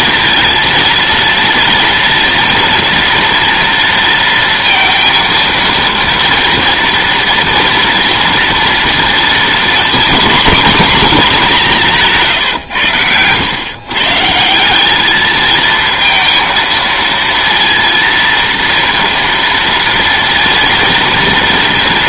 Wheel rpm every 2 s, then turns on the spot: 230, 230, 230, 230, 230, 240, 120, 180, 230, 230, 240.
none